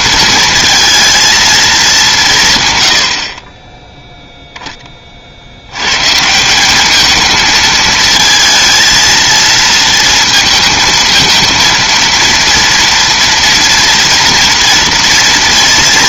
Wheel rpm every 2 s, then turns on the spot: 220, 140, 0, 180, 230, 230, 230, 230.
none